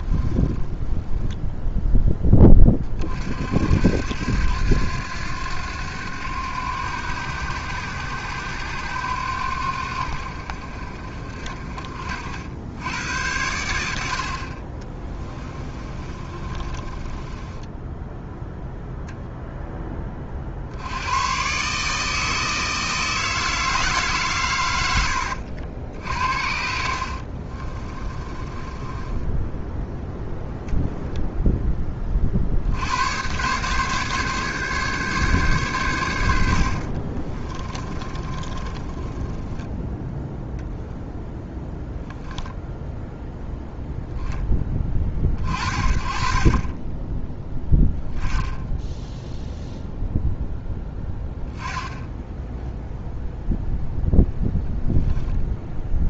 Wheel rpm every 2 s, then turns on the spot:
10, 30, 90, 90, 90, 60, 80, 40, 30, 0, 80, 160, 100, 60, 20, 0, 80, 140, 50, 20, 0, 0, 20, 20, 10, 10, 0, 0.
0-2 14-18 26-30 36-40